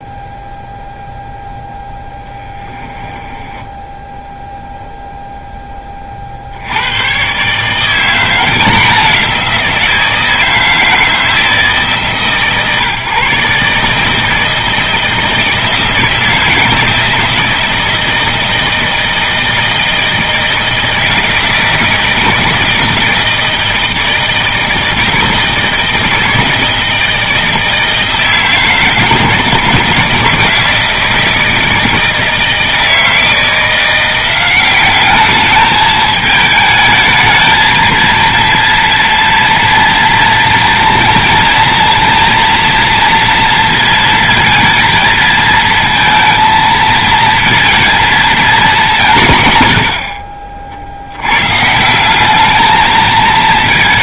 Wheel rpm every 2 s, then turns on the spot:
0, 10, 0, 90, 180, 160, 140, 160, 160, 160, 160, 160, 160, 160, 160, 160, 160, 190, 220, 230, 230, 230, 220, 230, 200, 60, 220.
2-4